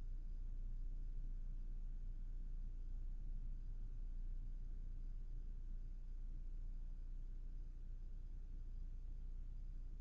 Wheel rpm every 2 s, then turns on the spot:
0, 0, 0, 0, 0.
none